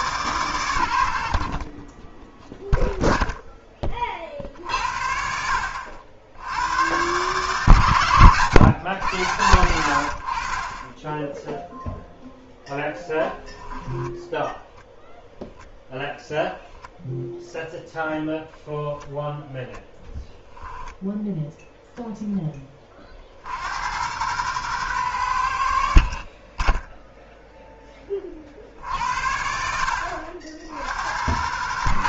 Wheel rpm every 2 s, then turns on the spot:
120, 0, 50, 100, 120, 30, 10, 10, 0, 0, 0, 20, 110, 10, 60, 70.
none